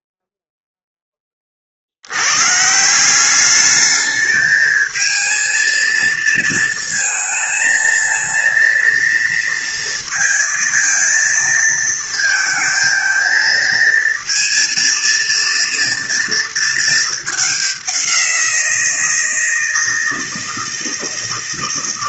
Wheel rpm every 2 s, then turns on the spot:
0, 160, 220, 230, 230, 230, 230, 230, 220, 170, 160.
none